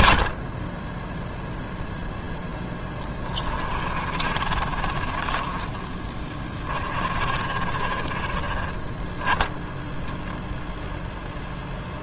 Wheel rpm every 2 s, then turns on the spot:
30, 10, 40, 30, 20, 0.
2-8